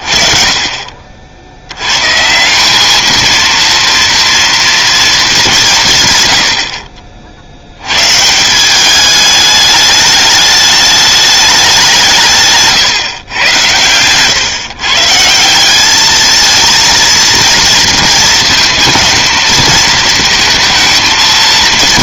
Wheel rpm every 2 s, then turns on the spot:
40, 200, 230, 60, 180, 210, 140, 140, 220, 230, 230.
none